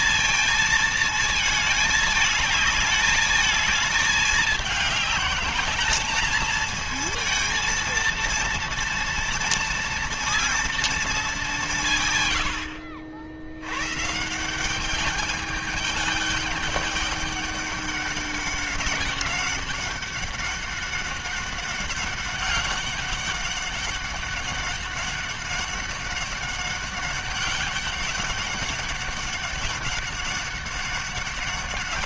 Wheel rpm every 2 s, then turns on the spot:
220, 210, 200, 220, 230, 220, 70, 200, 200, 190, 200, 200, 200, 200, 200, 200.
none